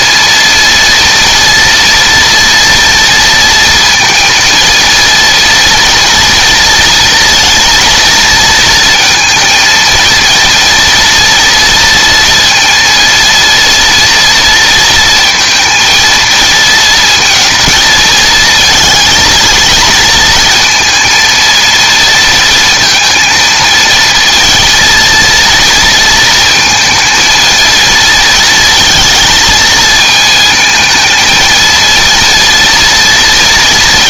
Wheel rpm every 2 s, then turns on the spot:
230, 230, 230, 230, 230, 230, 230, 230, 230, 230, 230, 230, 220, 220, 230, 220, 230.
none